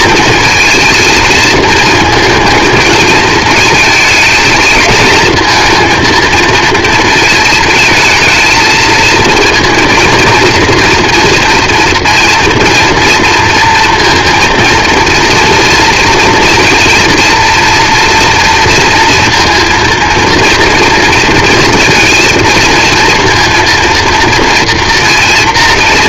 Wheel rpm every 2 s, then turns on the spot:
220, 220, 220, 220, 230, 230, 230, 230, 230, 230, 230, 230, 230.
none